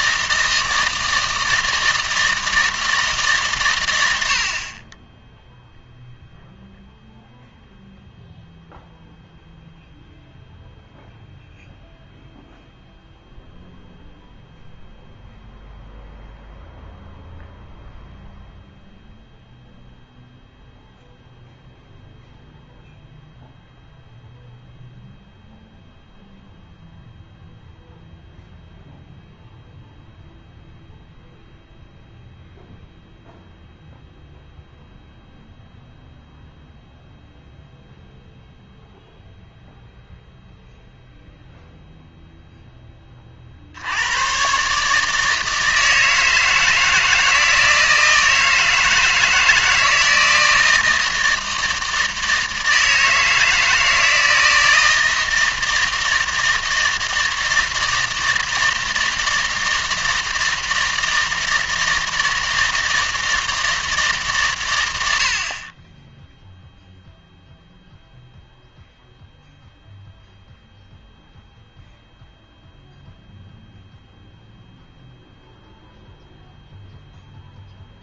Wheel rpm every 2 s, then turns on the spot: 160, 160, 20, 0, 0, 0, 0, 0, 0, 0, 0, 0, 0, 0, 0, 0, 0, 0, 0, 0, 0, 10, 140, 160, 160, 160, 160, 160, 160, 160, 160, 160, 110, 0, 0, 0, 0, 0, 0.
none